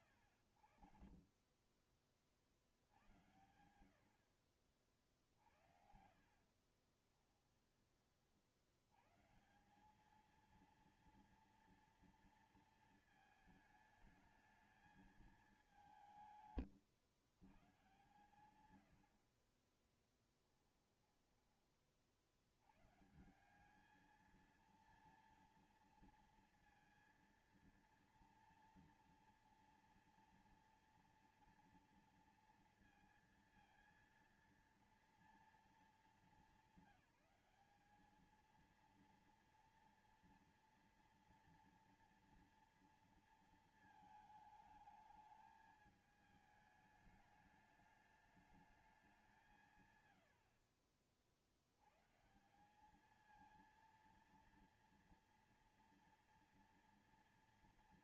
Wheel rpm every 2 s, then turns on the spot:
100, 50, 60, 60, 70, 220, 230, 220, 150, 100, 10, 80, 230, 230, 240, 240, 230, 230, 210, 220, 230, 230, 220, 220, 210, 70, 160, 230, 230.
6-8 16-22